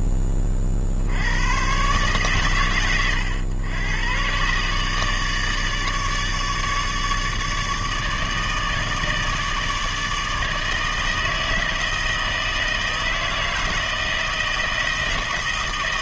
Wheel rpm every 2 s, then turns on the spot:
70, 100, 150, 150, 160, 160, 160, 160.
none